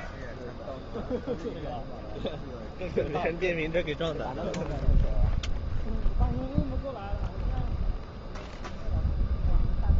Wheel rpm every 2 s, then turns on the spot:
0, 0, 0, 0, 0.
none